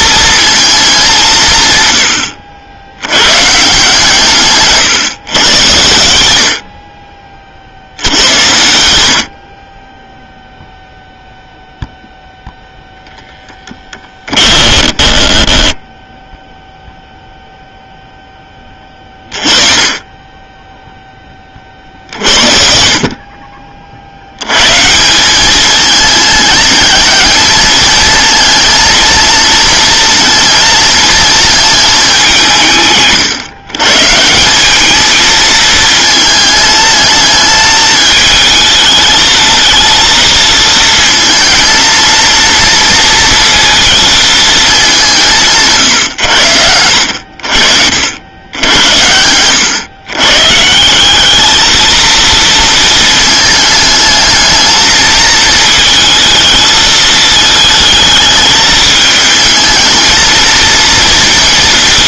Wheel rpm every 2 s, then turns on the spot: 230, 80, 130, 60, 100, 0, 0, 20, 0, 20, 10, 50, 110, 210, 230, 220, 160, 200, 220, 220, 230, 230, 210, 80, 90, 160, 230, 220, 220, 220, 230.
14-16